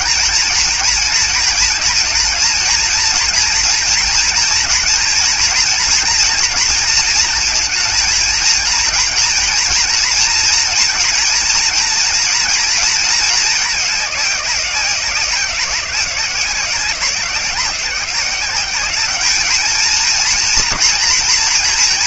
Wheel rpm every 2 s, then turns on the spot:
220, 220, 230, 230, 230, 230, 220, 180, 180, 200, 230.
none